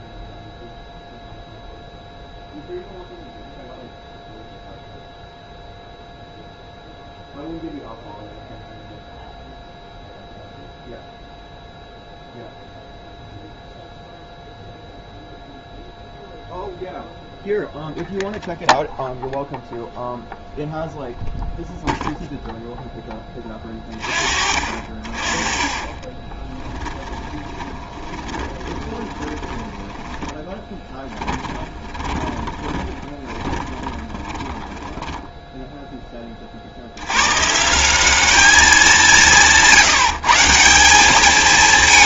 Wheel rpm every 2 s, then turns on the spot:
0, 0, 0, 0, 0, 0, 0, 0, 0, 0, 0, 0, 40, 20, 20, 20, 20, 20, 50, 200, 170.
26-36